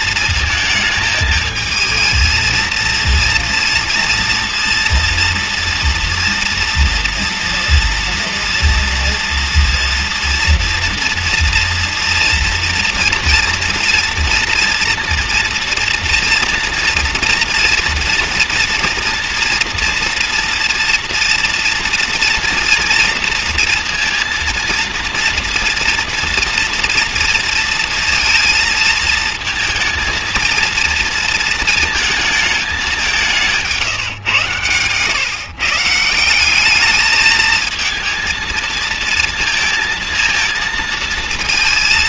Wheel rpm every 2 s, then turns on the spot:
220, 230, 230, 240, 230, 230, 240, 230, 230, 230, 230, 230, 240, 230, 220, 230, 180, 130, 220, 230, 230.
none